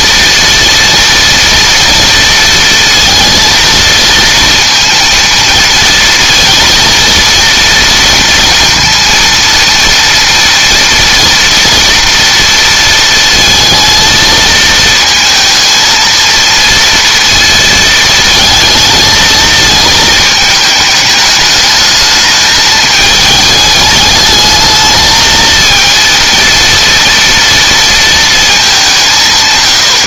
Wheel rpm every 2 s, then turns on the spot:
230, 230, 230, 230, 230, 230, 230, 220, 230, 220, 210, 220, 220, 230, 200.
none